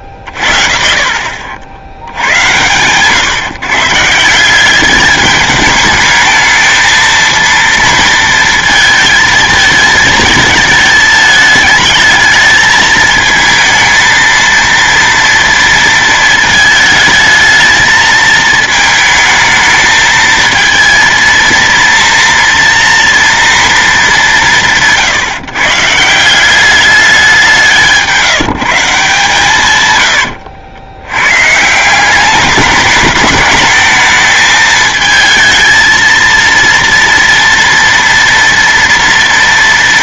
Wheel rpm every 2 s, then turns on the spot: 60, 100, 180, 220, 230, 220, 210, 230, 220, 220, 220, 230, 170, 180, 170, 90, 200, 220, 230, 240.
30-32